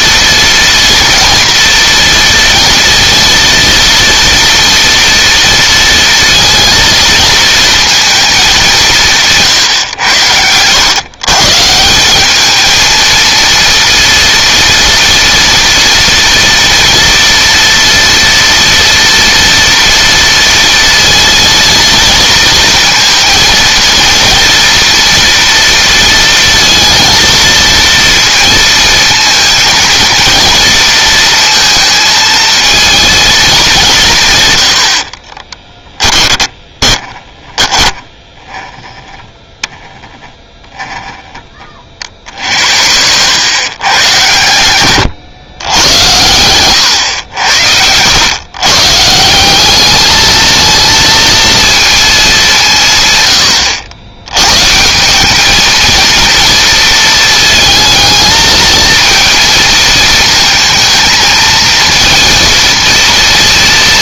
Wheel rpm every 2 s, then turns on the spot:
230, 240, 230, 230, 190, 110, 220, 230, 240, 230, 230, 230, 230, 230, 220, 230, 230, 90, 10, 10, 10, 70, 120, 100, 140, 230, 150, 160, 230, 220, 220, 230.
36-38